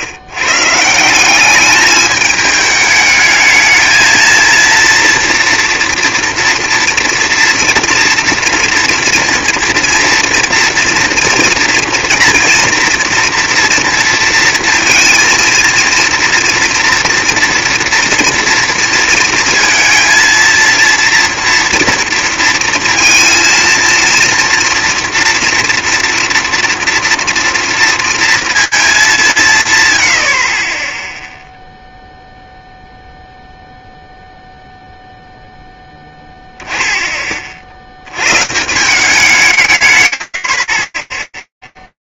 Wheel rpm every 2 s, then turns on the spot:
150, 210, 230, 230, 230, 230, 240, 230, 240, 240, 230, 230, 230, 240, 230, 70, 0, 0, 10, 180, 40.
none